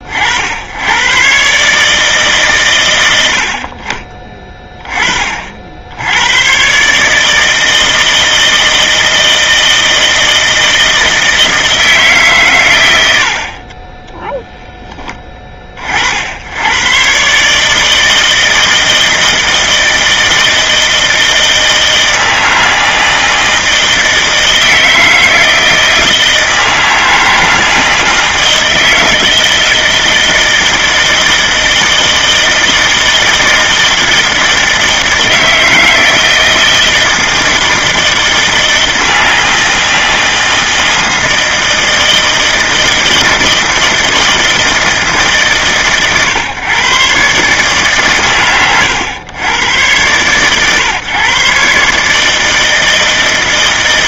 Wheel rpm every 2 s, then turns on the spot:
110, 110, 30, 140, 160, 160, 90, 10, 120, 160, 160, 160, 160, 160, 160, 160, 160, 160, 160, 160, 160, 160, 150, 120, 130, 130, 160.
none